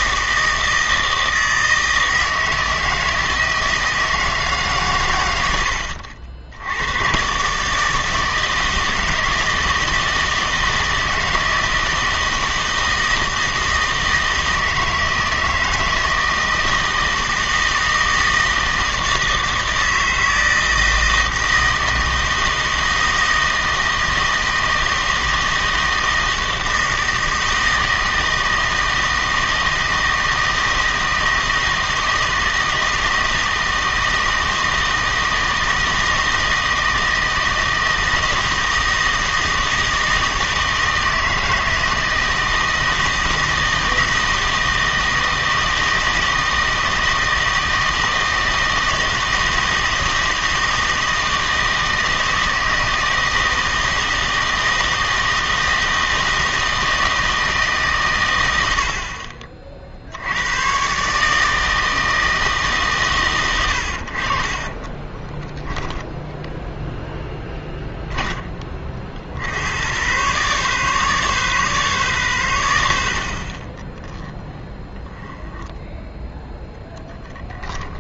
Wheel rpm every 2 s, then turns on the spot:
160, 160, 140, 80, 160, 160, 160, 160, 160, 160, 160, 160, 160, 160, 160, 160, 160, 160, 160, 160, 160, 160, 160, 160, 160, 160, 160, 160, 160, 80, 120, 150, 30, 0, 20, 140, 80, 10, 10.
64-66 74-78